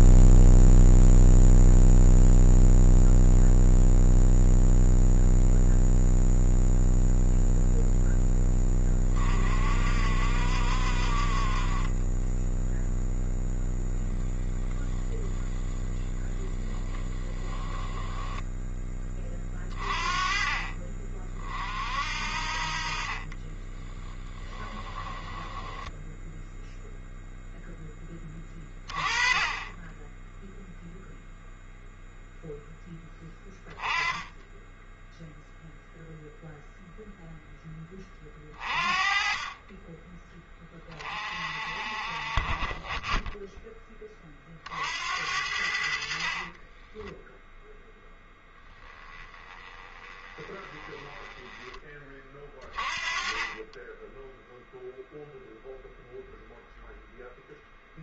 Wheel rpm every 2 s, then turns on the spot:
0, 0, 0, 0, 20, 50, 0, 0, 10, 10, 40, 40, 10, 0, 20, 0, 10, 10, 0, 30, 30, 20, 60, 20, 10, 20, 30, 0, 0.
16-18 24-26 46-48